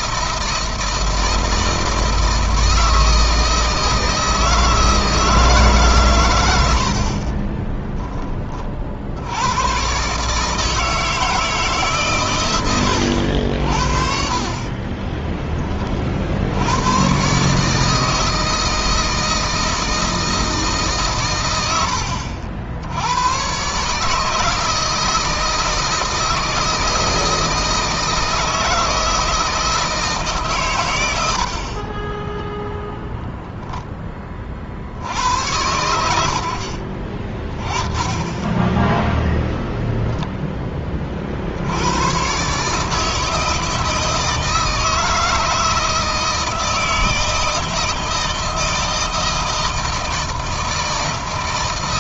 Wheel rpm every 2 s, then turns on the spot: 160, 160, 160, 80, 40, 150, 100, 30, 100, 160, 150, 80, 160, 160, 160, 120, 0, 60, 50, 10, 20, 140, 160, 160, 160, 160.
14-16